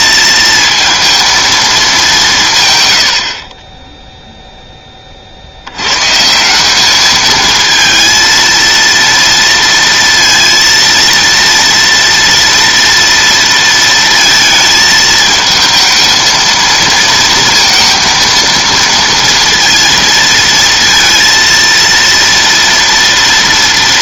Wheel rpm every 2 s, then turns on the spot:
230, 130, 10, 180, 230, 230, 230, 220, 230, 230, 230, 230.
none